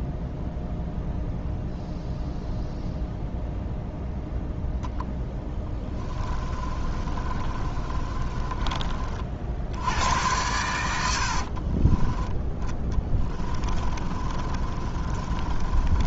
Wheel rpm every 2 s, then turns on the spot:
0, 0, 0, 30, 30, 90, 10, 30.
6-8 10-16